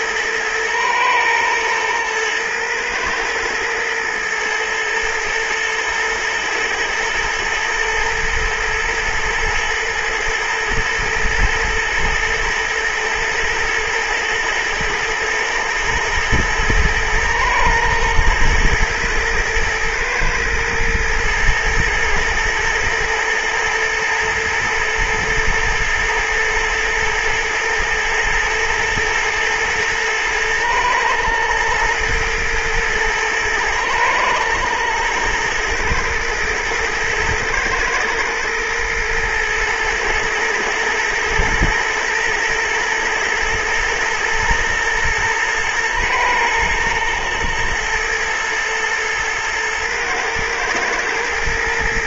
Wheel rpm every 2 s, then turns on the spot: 110, 110, 120, 120, 110, 110, 120, 110, 120, 110, 120, 110, 120, 110, 110, 110, 120, 110, 110, 120, 110, 110, 120, 110, 110, 110.
none